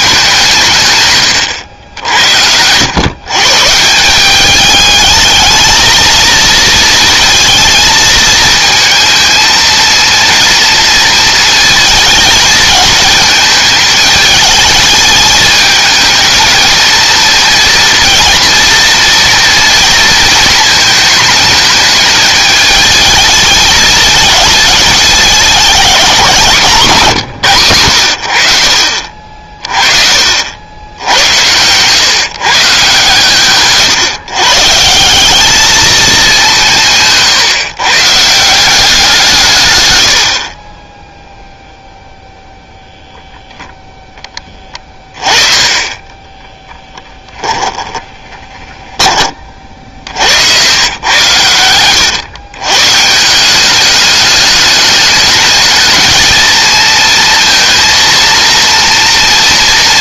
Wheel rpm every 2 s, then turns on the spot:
160, 110, 210, 230, 220, 230, 220, 210, 230, 240, 220, 220, 210, 170, 80, 90, 140, 150, 170, 180, 20, 10, 20, 10, 20, 90, 130, 210, 220, 230.
46-50